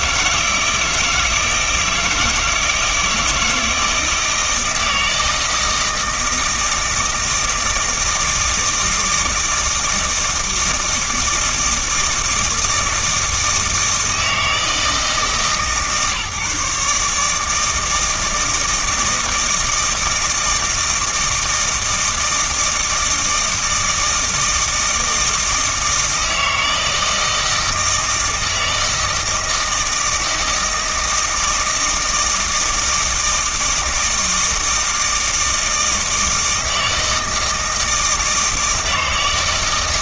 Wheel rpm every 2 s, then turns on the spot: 160, 160, 160, 160, 160, 160, 160, 160, 150, 160, 160, 160, 160, 160, 160, 160, 160, 160, 160, 160.
none